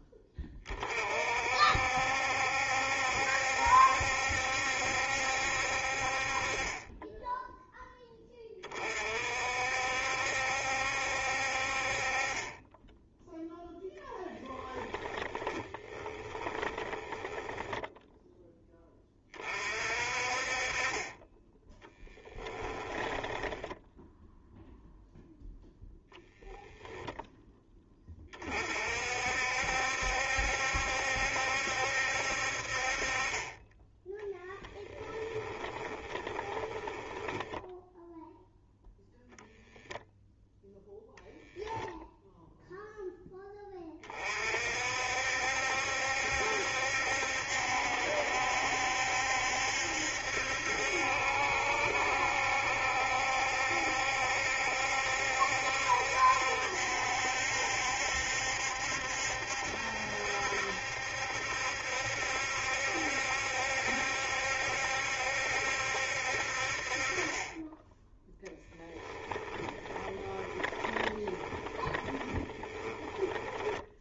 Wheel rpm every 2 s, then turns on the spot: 40, 70, 70, 20, 30, 70, 10, 20, 20, 20, 30, 10, 0, 10, 50, 70, 40, 10, 10, 0, 0, 0, 50, 70, 70, 70, 70, 70, 70, 70, 70, 70, 70, 40, 10, 20, 20.
14-18 22-24 34-38 68-74